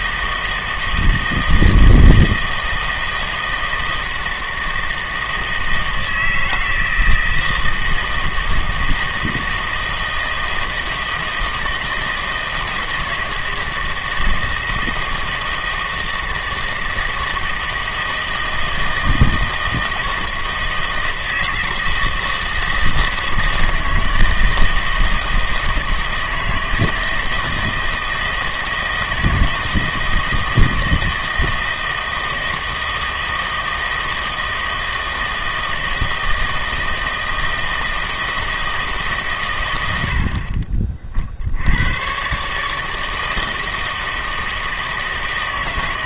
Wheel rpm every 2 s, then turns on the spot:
160, 160, 160, 160, 160, 160, 160, 160, 160, 160, 160, 160, 160, 160, 160, 160, 160, 160, 160, 160, 30, 150, 160.
none